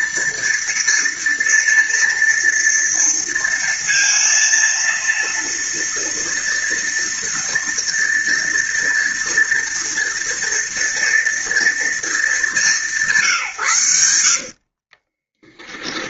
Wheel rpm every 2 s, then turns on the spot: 230, 230, 230, 230, 230, 230, 160, 50.
14-16